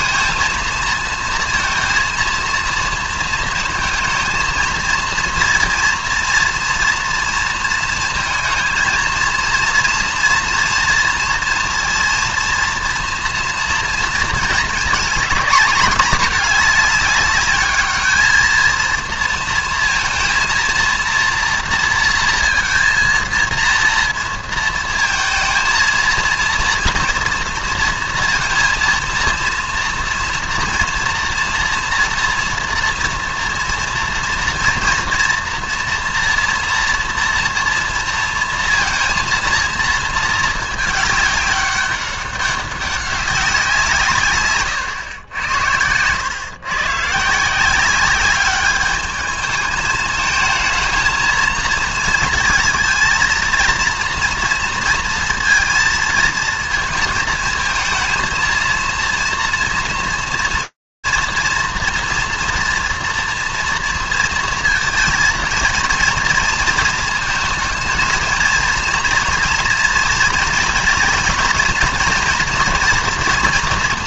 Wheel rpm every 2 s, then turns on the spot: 230, 230, 230, 230, 230, 230, 230, 220, 210, 230, 230, 230, 230, 230, 230, 230, 230, 230, 230, 230, 220, 200, 130, 120, 200, 220, 230, 230, 230, 230, 230, 230, 230, 220, 230, 230, 230.
none